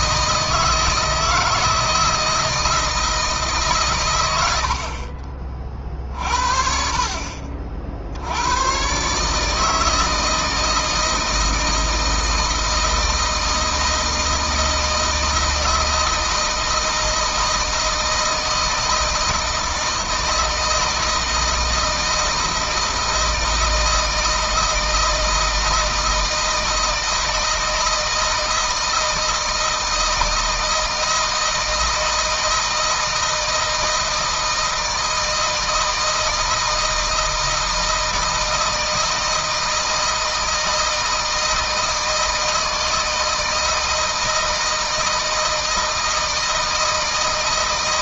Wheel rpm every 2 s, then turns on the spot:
160, 160, 70, 50, 110, 160, 160, 160, 160, 160, 160, 160, 160, 160, 160, 160, 160, 160, 160, 160, 160, 160, 160, 160.
none